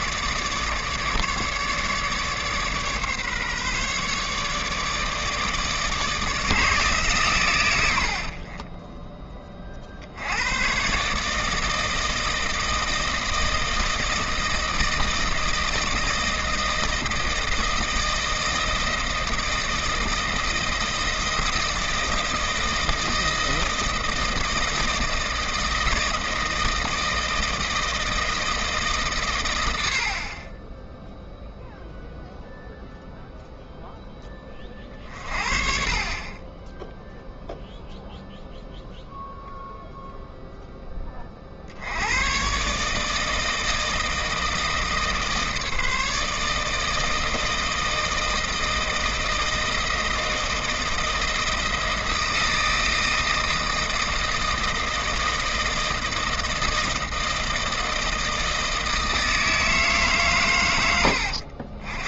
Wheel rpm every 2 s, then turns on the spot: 150, 140, 150, 150, 20, 130, 160, 160, 160, 160, 160, 160, 160, 160, 160, 10, 0, 40, 10, 0, 10, 140, 160, 160, 160, 160, 160, 160, 160, 160, 100.
8-10